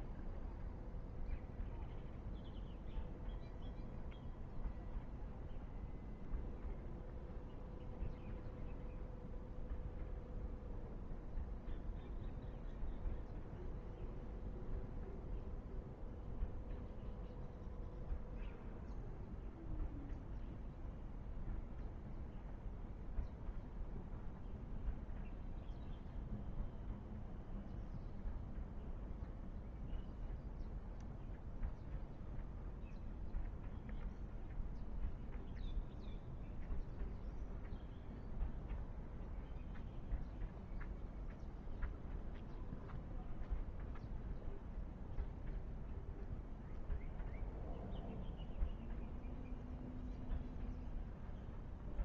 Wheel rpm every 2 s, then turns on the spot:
0, 0, 0, 0, 0, 0, 0, 0, 0, 0, 0, 0, 0, 0, 0, 0, 0, 0, 0, 0, 0, 0, 0, 0, 0, 0.
none